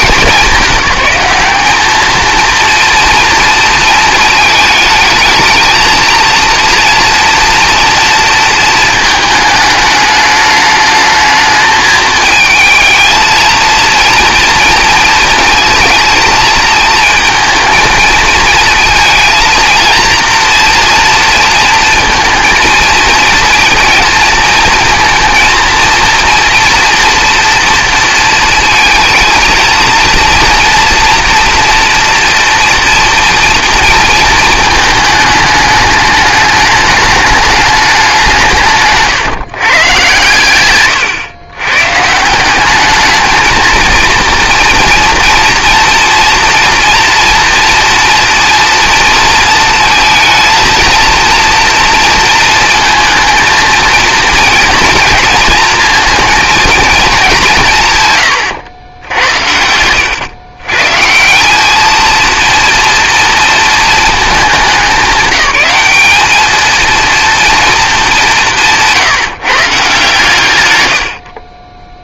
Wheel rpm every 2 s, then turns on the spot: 200, 230, 220, 230, 220, 210, 230, 230, 220, 220, 230, 230, 230, 230, 230, 230, 230, 220, 210, 150, 130, 200, 230, 240, 230, 220, 220, 240, 220, 90, 140, 230, 200, 230, 170, 100.
40-42 58-60